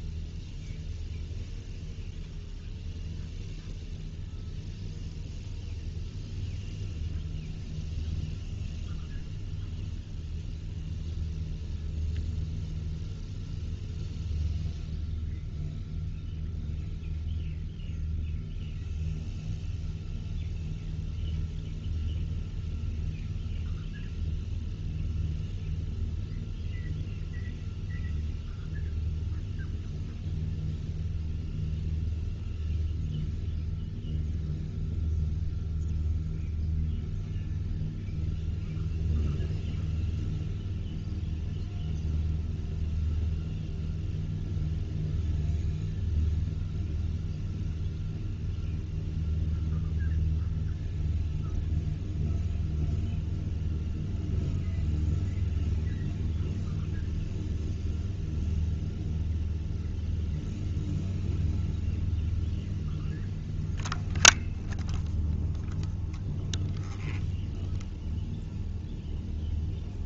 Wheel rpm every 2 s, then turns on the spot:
0, 0, 0, 0, 0, 0, 0, 0, 0, 0, 0, 0, 0, 0, 0, 0, 0, 0, 0, 0, 0, 0, 0, 0, 0, 0, 0, 0, 0, 0, 0, 0, 0, 0, 0.
none